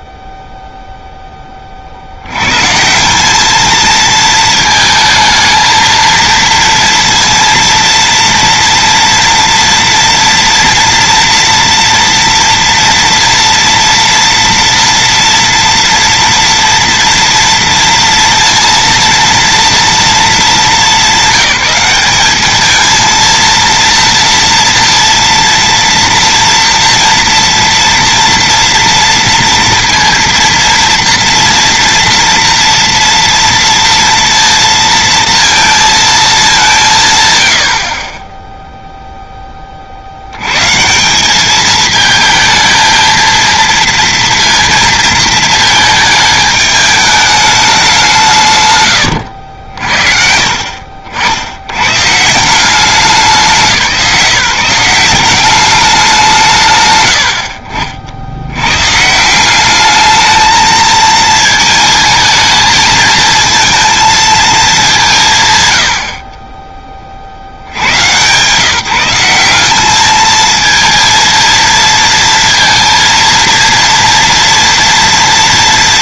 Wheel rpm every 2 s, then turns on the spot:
0, 170, 220, 230, 230, 230, 230, 230, 230, 230, 190, 220, 230, 230, 230, 230, 230, 230, 160, 0, 170, 230, 230, 210, 110, 60, 180, 180, 100, 150, 220, 220, 170, 50, 180, 230, 230, 230.
none